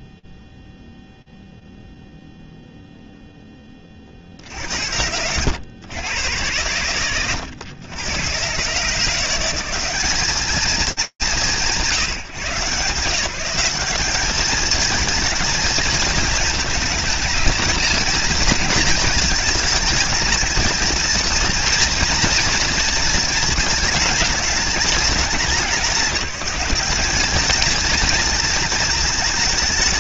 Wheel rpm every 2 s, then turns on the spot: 0, 0, 0, 80, 100, 150, 190, 160, 220, 220, 220, 230, 220, 210, 210.
none